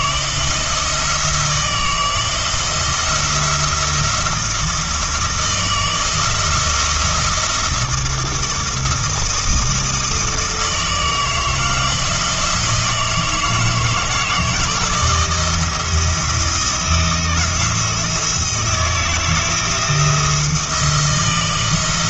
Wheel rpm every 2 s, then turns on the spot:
160, 170, 170, 170, 170, 160, 160, 160, 170, 160, 170.
none